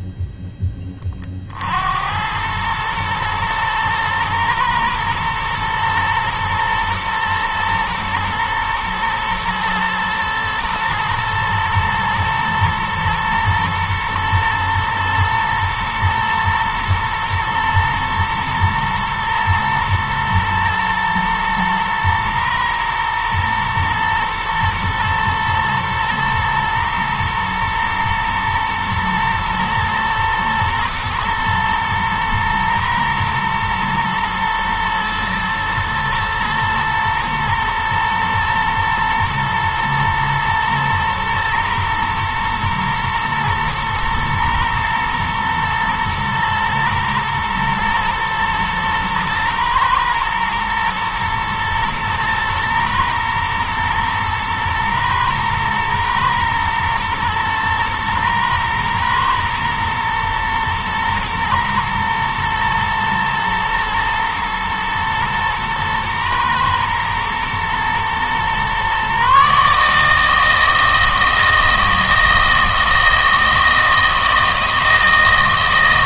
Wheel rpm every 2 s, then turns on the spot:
10, 110, 110, 110, 110, 120, 110, 110, 120, 110, 110, 110, 120, 110, 110, 110, 120, 120, 110, 120, 120, 110, 110, 110, 110, 110, 120, 110, 110, 110, 120, 110, 110, 110, 130, 160, 160, 160.
none